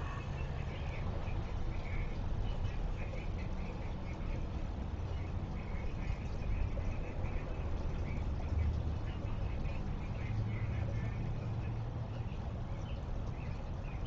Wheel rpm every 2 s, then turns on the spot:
0, 0, 0, 0, 0, 0, 0.
none